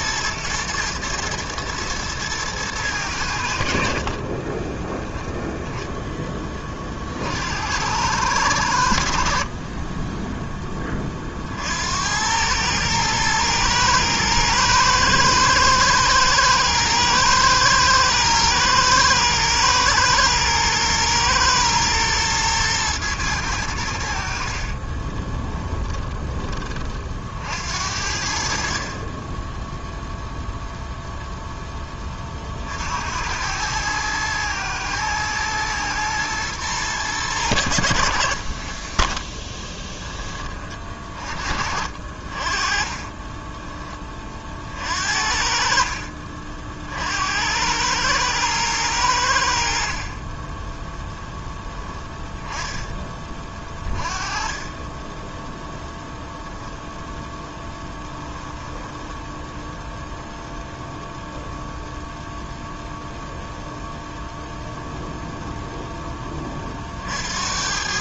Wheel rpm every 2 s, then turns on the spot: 110, 110, 20, 20, 100, 10, 100, 110, 110, 110, 110, 110, 50, 30, 50, 0, 40, 110, 110, 50, 20, 40, 40, 50, 100, 20, 10, 20, 0, 10, 0, 0, 0, 20.
4-6 24-26 38-40 58-60